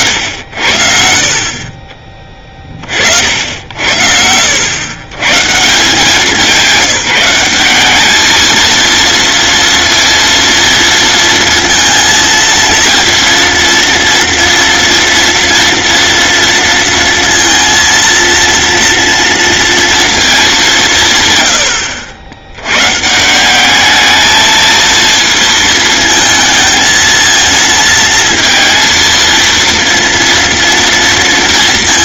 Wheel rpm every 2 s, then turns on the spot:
70, 50, 110, 190, 230, 230, 230, 230, 230, 230, 180, 120, 220, 220, 230, 230.
none